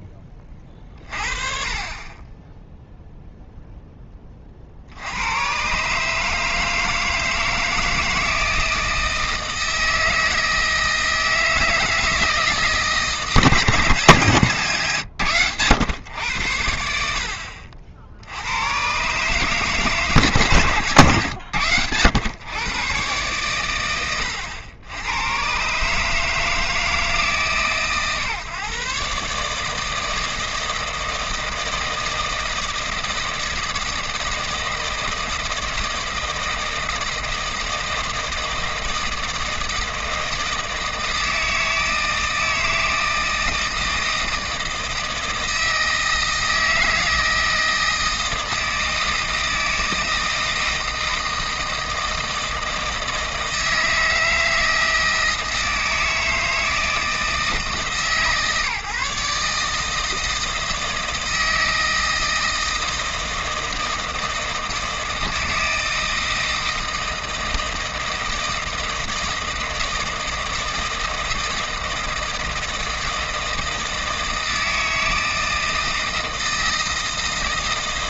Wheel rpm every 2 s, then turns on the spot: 30, 0, 50, 160, 160, 160, 160, 130, 80, 110, 130, 120, 100, 160, 130, 160, 160, 160, 160, 160, 160, 160, 160, 160, 160, 160, 160, 160, 160, 150, 160, 160, 160, 160, 160, 160, 160, 160, 160.
none